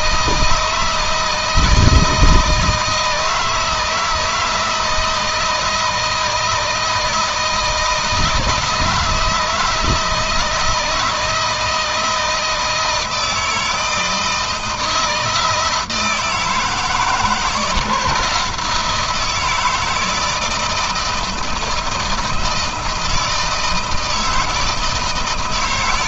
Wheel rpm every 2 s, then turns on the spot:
160, 160, 160, 160, 160, 160, 160, 160, 160, 170, 160, 160, 160.
none